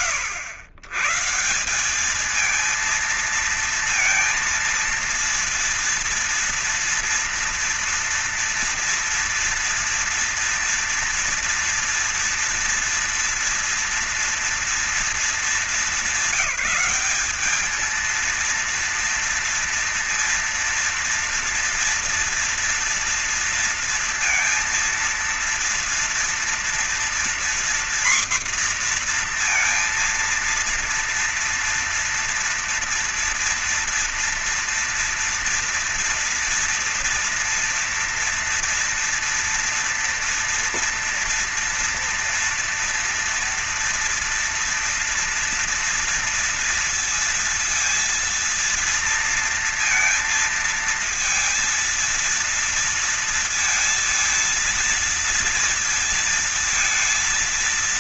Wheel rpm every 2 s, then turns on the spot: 120, 220, 230, 230, 230, 230, 240, 230, 200, 230, 230, 230, 230, 240, 240, 230, 230, 240, 230, 230, 230, 230, 230, 230, 230, 230, 230, 220, 230.
none